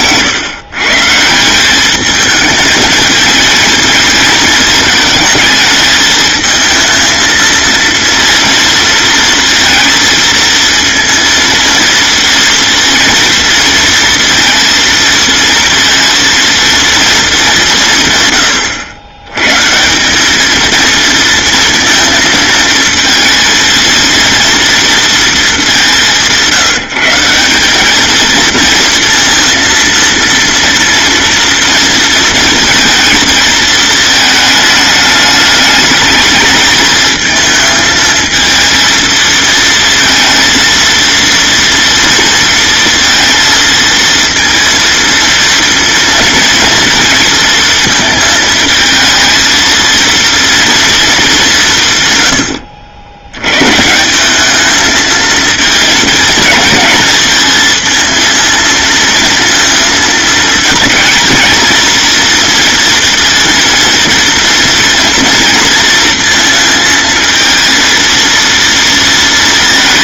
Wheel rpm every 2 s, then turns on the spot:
130, 210, 220, 220, 230, 230, 230, 230, 230, 120, 220, 220, 230, 170, 230, 230, 230, 220, 210, 230, 230, 230, 230, 230, 220, 230, 100, 210, 220, 230, 220, 230, 230, 230, 230.
none